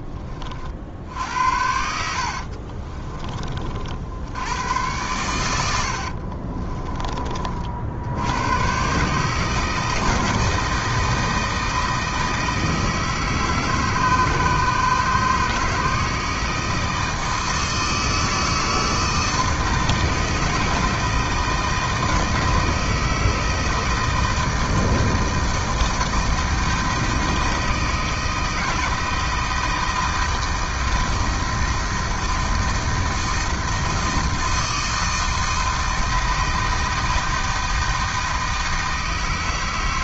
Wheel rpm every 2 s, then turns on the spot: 60, 30, 100, 30, 130, 160, 160, 150, 160, 160, 160, 160, 160, 160, 160, 160, 160, 160, 160, 160.
2-4 6-8